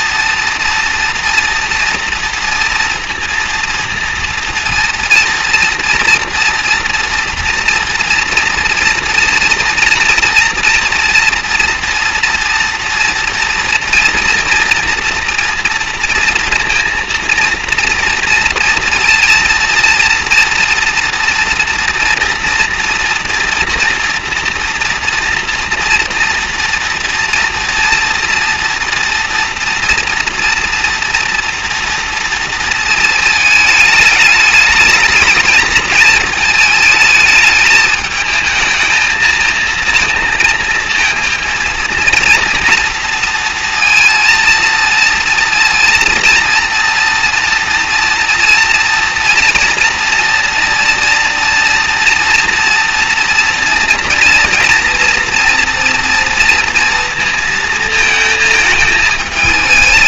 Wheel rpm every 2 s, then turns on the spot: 230, 230, 230, 230, 230, 230, 230, 230, 230, 230, 230, 230, 230, 230, 230, 230, 230, 210, 220, 220, 230, 230, 230, 230, 230, 230, 230, 240, 230, 220.
none